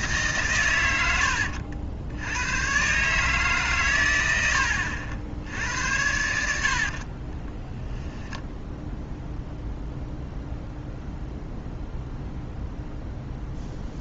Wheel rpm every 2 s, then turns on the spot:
120, 120, 80, 60, 0, 0, 0.
6-8